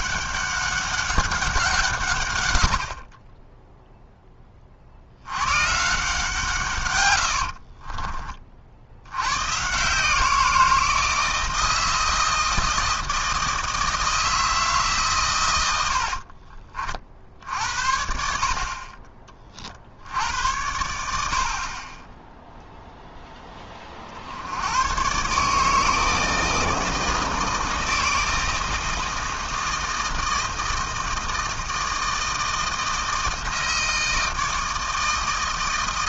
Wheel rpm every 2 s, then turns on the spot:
200, 90, 40, 130, 60, 170, 160, 160, 40, 50, 90, 0, 90, 160, 160, 160, 160, 160.
none